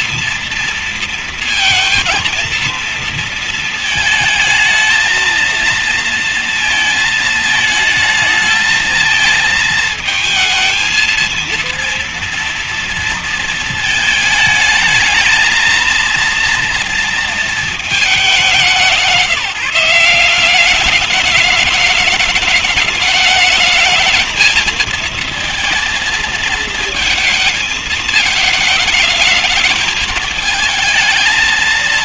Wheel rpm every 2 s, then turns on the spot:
230, 230, 220, 220, 220, 220, 230, 220, 230, 190, 190, 210, 220, 230, 220, 220.
none